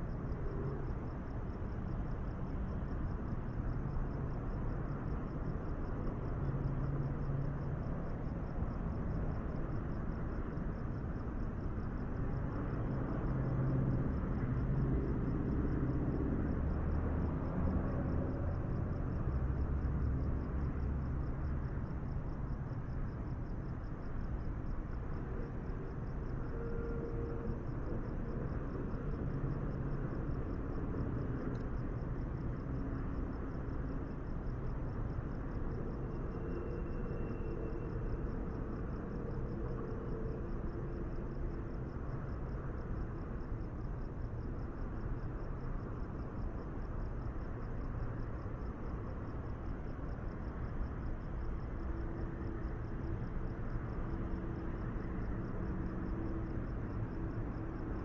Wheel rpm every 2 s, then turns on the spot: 0, 0, 0, 0, 0, 0, 0, 0, 0, 0, 0, 0, 0, 0, 0, 0, 0, 0, 0, 0, 0, 0, 0, 0, 0, 0, 0, 0, 0.
none